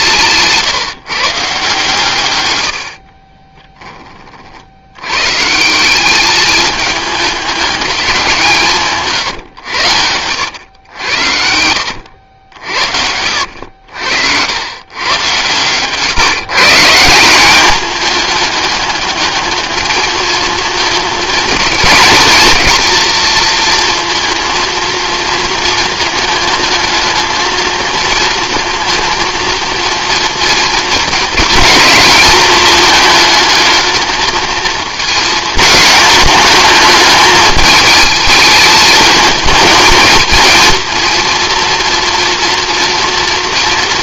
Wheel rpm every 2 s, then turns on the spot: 150, 80, 70, 210, 160, 100, 60, 110, 160, 210, 220, 230, 230, 220, 230, 230, 210, 220, 210, 210, 230, 230.
2-4 12-14